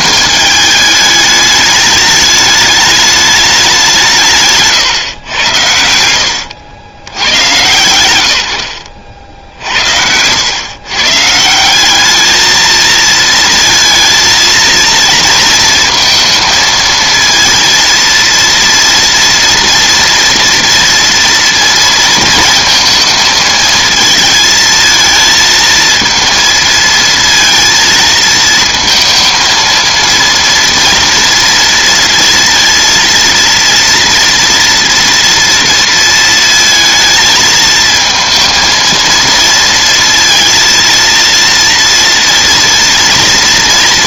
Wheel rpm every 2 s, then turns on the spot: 210, 210, 130, 60, 100, 120, 220, 230, 220, 230, 240, 230, 220, 230, 220, 230, 230, 230, 220, 230, 230, 230.
none